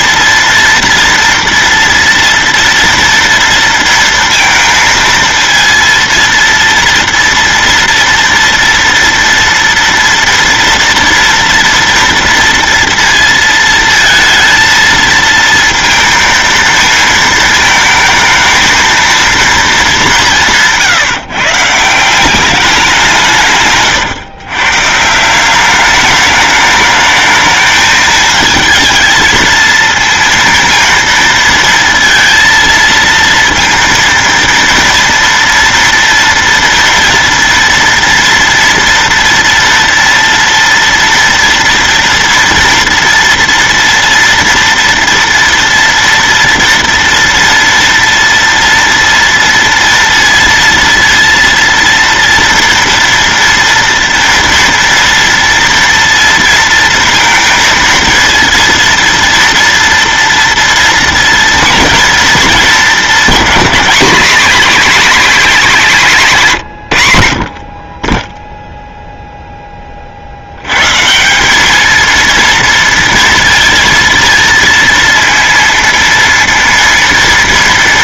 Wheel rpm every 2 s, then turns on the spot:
230, 230, 230, 230, 230, 230, 230, 230, 220, 220, 170, 190, 130, 210, 220, 230, 230, 230, 230, 230, 230, 230, 230, 230, 230, 230, 230, 230, 230, 230, 230, 220, 230, 150, 0, 100, 230, 230, 230.
none